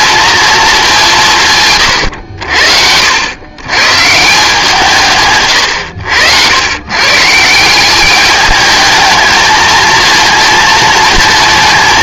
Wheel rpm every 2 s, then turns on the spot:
220, 70, 170, 110, 220, 230.
none